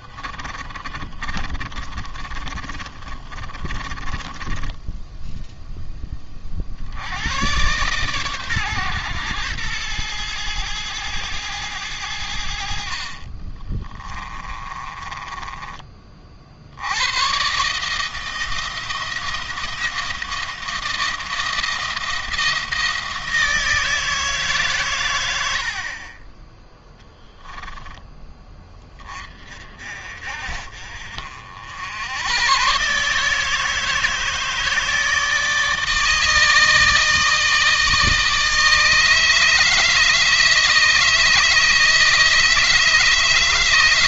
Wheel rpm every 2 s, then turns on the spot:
30, 30, 20, 50, 120, 110, 60, 20, 60, 170, 160, 170, 130, 10, 20, 50, 130, 160, 160, 160, 160, 160.
0-6 14-16